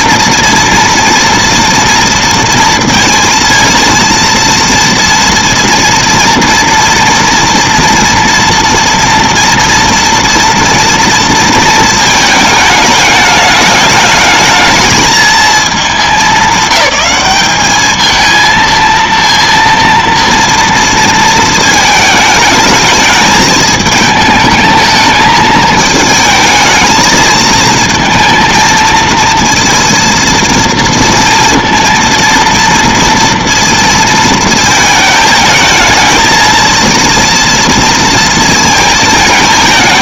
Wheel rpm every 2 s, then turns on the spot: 230, 230, 230, 230, 230, 230, 220, 220, 190, 230, 230, 220, 210, 220, 230, 230, 230, 220, 230, 230.
none